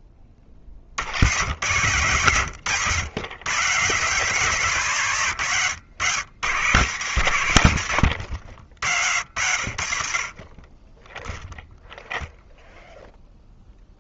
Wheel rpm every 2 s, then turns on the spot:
10, 110, 150, 120, 70, 20, 0.
none